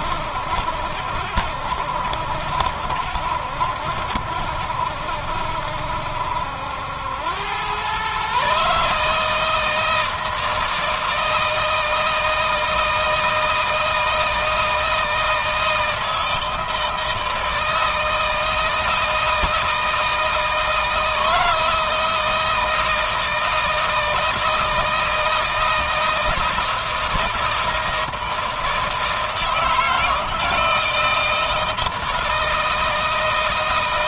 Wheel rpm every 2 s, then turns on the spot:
70, 70, 70, 80, 140, 160, 160, 160, 160, 160, 160, 170, 160, 170, 160, 160, 160.
none